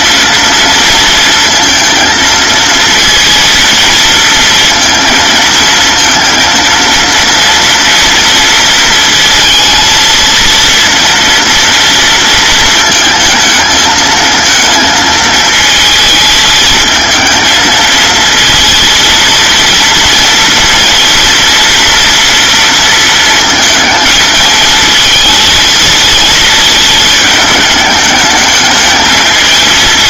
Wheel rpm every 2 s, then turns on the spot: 230, 230, 230, 230, 230, 230, 220, 220, 220, 230, 230, 220, 220, 210, 210.
none